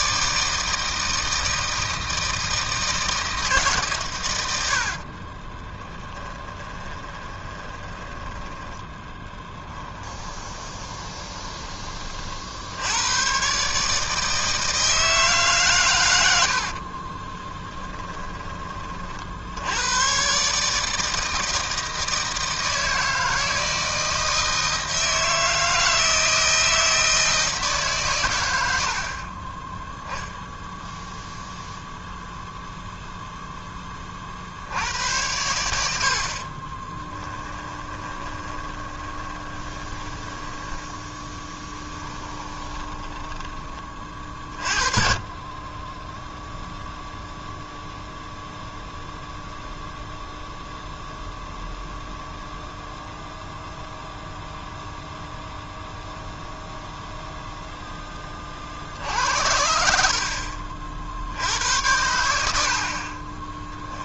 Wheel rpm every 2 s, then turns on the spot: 160, 150, 20, 20, 10, 20, 110, 150, 30, 60, 160, 160, 160, 160, 40, 0, 0, 80, 20, 20, 10, 10, 30, 0, 0, 0, 0, 0, 0, 40, 50, 70.
4-12 16-18 36-40 42-44